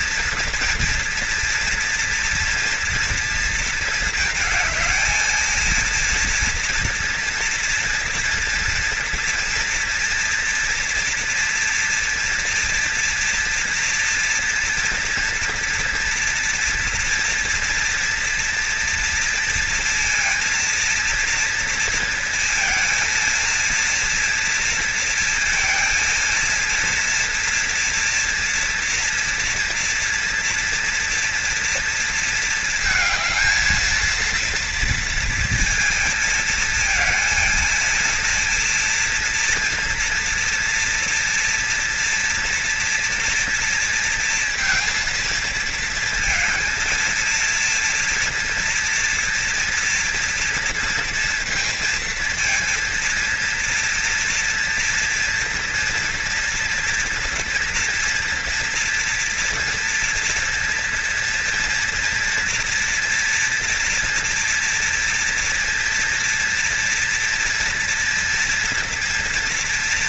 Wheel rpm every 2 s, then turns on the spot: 230, 230, 220, 240, 230, 240, 240, 230, 230, 230, 230, 230, 230, 230, 230, 230, 230, 230, 230, 240, 230, 240, 230, 230, 240, 230, 230, 230, 230, 230, 230, 240, 240, 230, 230.
none